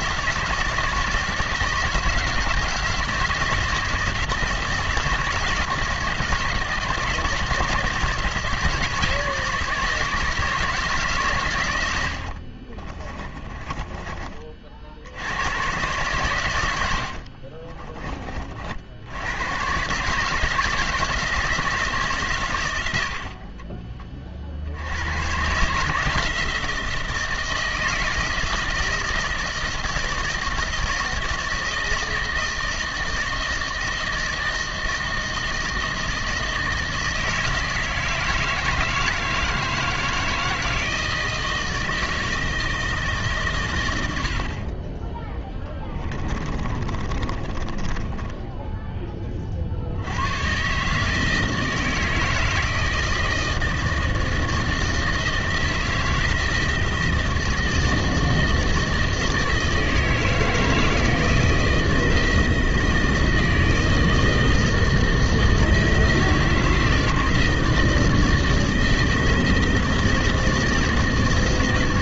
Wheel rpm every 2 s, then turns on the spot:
160, 160, 160, 160, 160, 160, 50, 40, 110, 50, 160, 120, 50, 160, 160, 160, 160, 160, 160, 160, 160, 160, 40, 30, 10, 120, 160, 160, 160, 160, 160, 160, 160, 160, 160, 160.
12-14 46-48